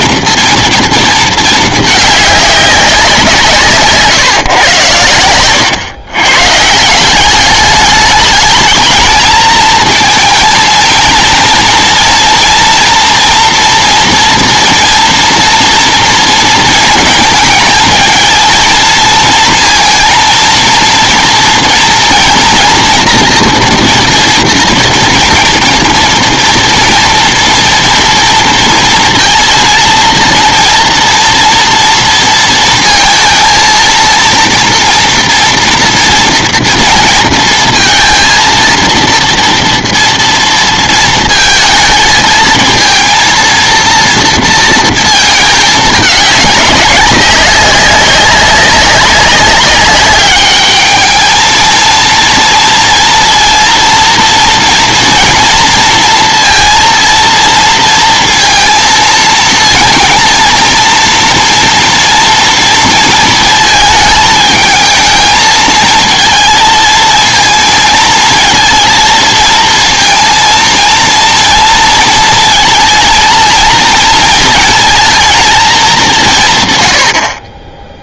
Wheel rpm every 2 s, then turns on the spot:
230, 200, 120, 150, 220, 230, 230, 230, 230, 220, 230, 240, 230, 230, 230, 230, 230, 230, 230, 230, 230, 230, 230, 200, 190, 210, 230, 230, 230, 230, 230, 230, 220, 220, 230, 230, 230, 230, 130.
none